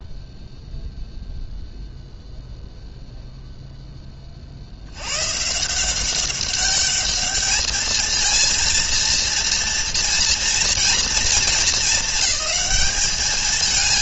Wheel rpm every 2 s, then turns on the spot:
0, 0, 50, 200, 230, 230, 210.
none